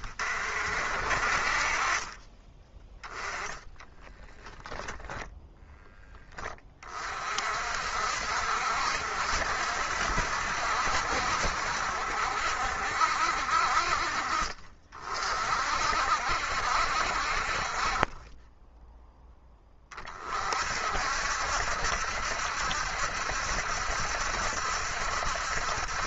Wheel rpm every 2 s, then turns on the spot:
40, 20, 10, 30, 60, 70, 70, 40, 60, 10, 50, 70, 70.
none